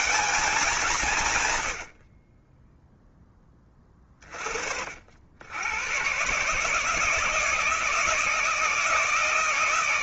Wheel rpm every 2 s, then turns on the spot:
190, 10, 60, 160, 160.
none